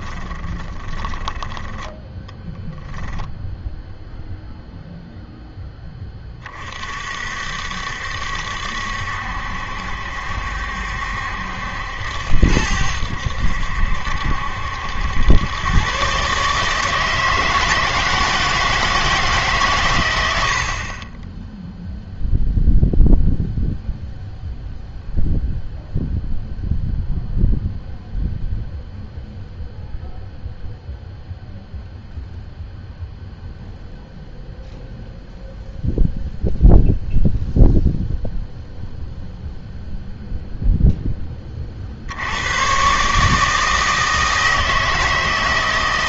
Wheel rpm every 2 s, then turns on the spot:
20, 0, 0, 40, 70, 70, 80, 70, 150, 160, 50, 0, 0, 0, 0, 0, 0, 0, 0, 0, 0, 110, 160.
0-2